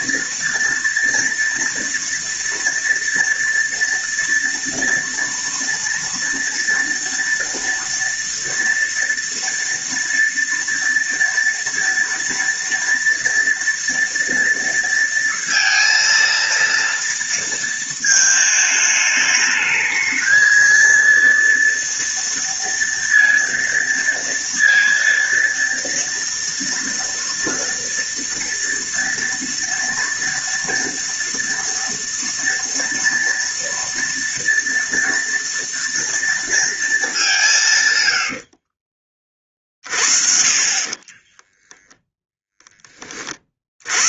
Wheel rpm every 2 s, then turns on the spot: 230, 230, 230, 230, 230, 230, 230, 230, 230, 210, 230, 230, 230, 230, 230, 230, 230, 230, 220, 40, 40, 10.
38-42